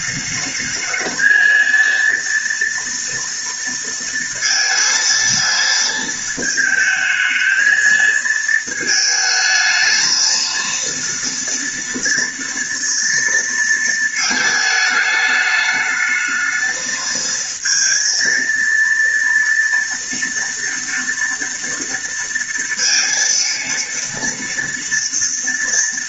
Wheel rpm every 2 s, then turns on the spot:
220, 230, 230, 220, 220, 230, 230, 220, 220, 230, 230, 230, 230.
none